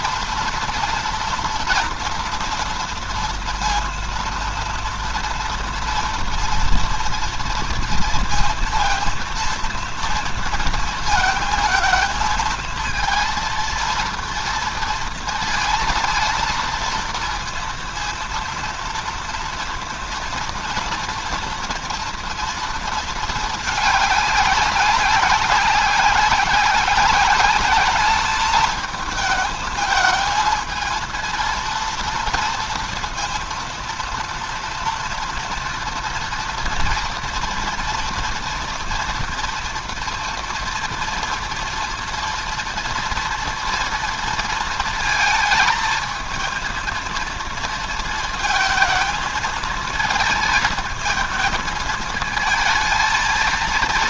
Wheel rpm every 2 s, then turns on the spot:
230, 230, 230, 230, 230, 230, 220, 230, 230, 230, 230, 230, 200, 190, 220, 220, 230, 230, 230, 230, 230, 230, 230, 230, 220, 220, 220.
none